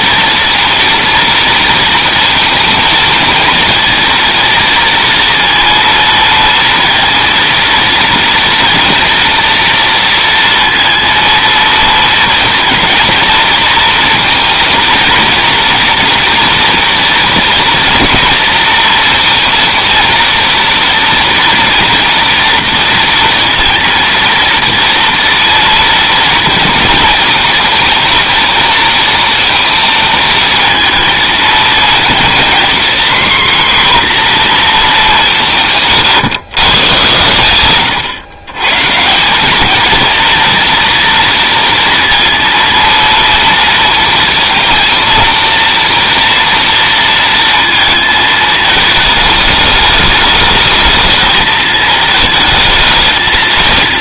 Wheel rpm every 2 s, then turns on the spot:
230, 230, 230, 230, 230, 230, 230, 230, 240, 230, 230, 230, 230, 240, 230, 220, 230, 250, 130, 110, 230, 230, 230, 230, 220, 210, 220.
none